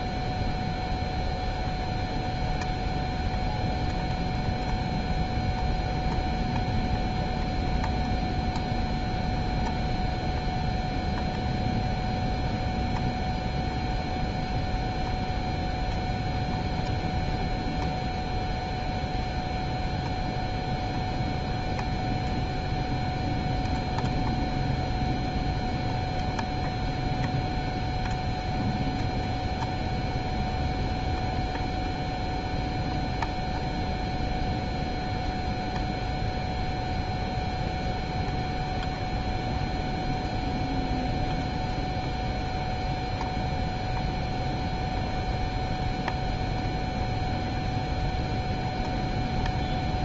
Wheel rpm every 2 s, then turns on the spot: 0, 0, 0, 0, 0, 0, 0, 0, 0, 0, 0, 0, 0, 0, 0, 0, 0, 0, 0, 0, 0, 0, 0, 0, 0.
none